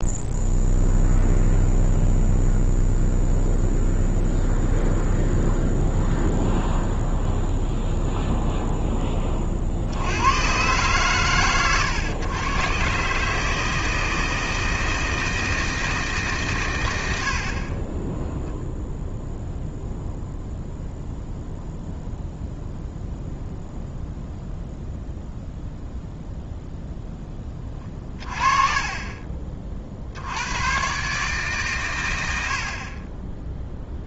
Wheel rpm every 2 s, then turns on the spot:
0, 0, 0, 0, 0, 120, 120, 160, 120, 0, 0, 0, 0, 0, 30, 110, 60.
none